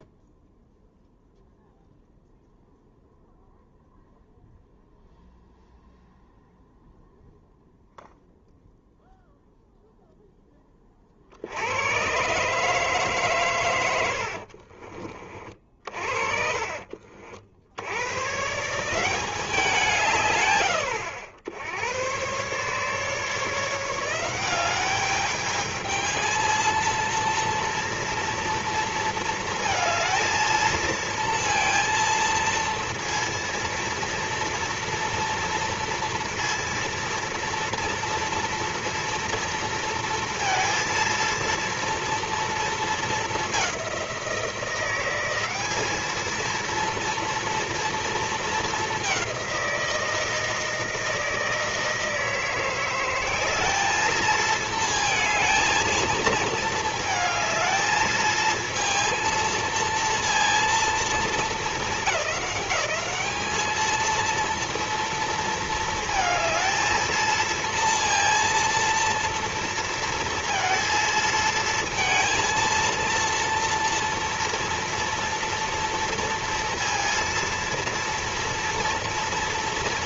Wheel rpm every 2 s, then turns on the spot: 0, 0, 0, 0, 0, 0, 130, 70, 50, 130, 140, 120, 180, 220, 230, 220, 230, 230, 230, 230, 230, 230, 180, 220, 220, 160, 160, 220, 220, 220, 230, 210, 230, 220, 230, 230, 230, 230, 230, 230.
14-16